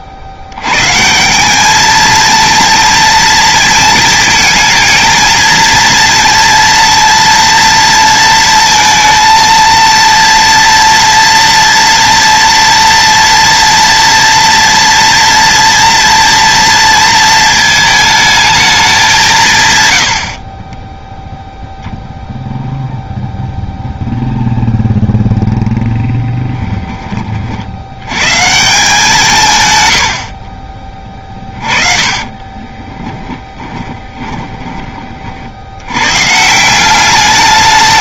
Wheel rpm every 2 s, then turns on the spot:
130, 230, 230, 230, 230, 230, 230, 240, 230, 210, 20, 0, 0, 20, 170, 30, 20, 20, 190.
32-34